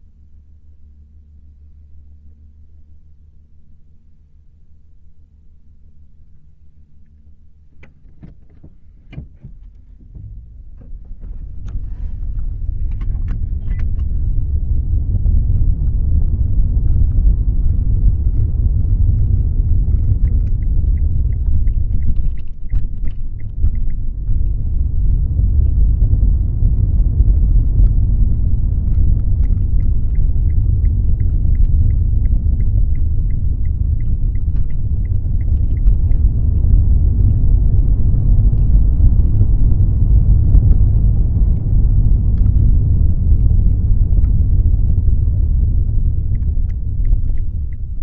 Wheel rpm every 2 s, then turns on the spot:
0, 0, 0, 0, 0, 0, 0, 0, 0, 0, 0, 0, 0, 0, 0, 0, 0, 0, 0, 0, 0, 0, 0, 0.
none